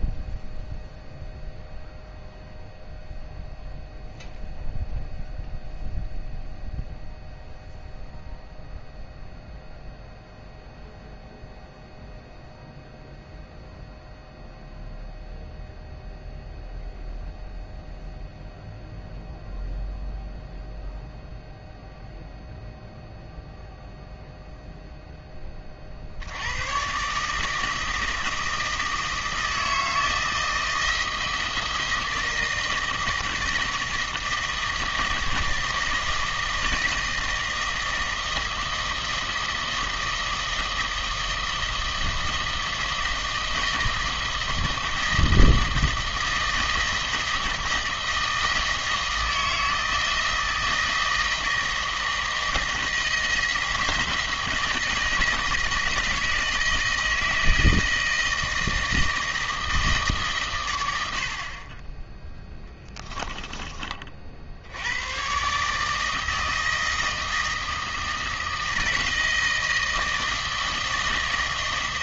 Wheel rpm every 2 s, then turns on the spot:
0, 0, 0, 0, 0, 0, 0, 0, 0, 0, 0, 0, 0, 110, 160, 160, 160, 160, 160, 160, 160, 160, 160, 160, 160, 160, 160, 160, 160, 160, 110, 10, 80, 160, 160, 160.
62-64